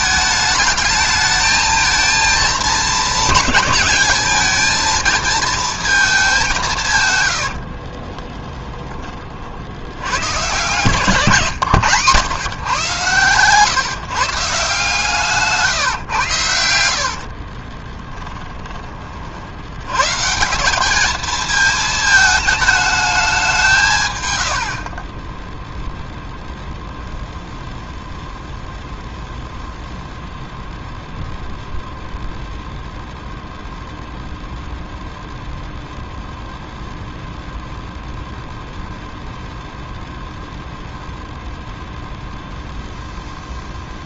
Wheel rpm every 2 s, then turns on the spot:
210, 220, 220, 170, 20, 140, 130, 150, 80, 20, 190, 220, 70, 0, 0, 0, 0, 0, 0, 0, 0, 0.
8-10 16-18 24-26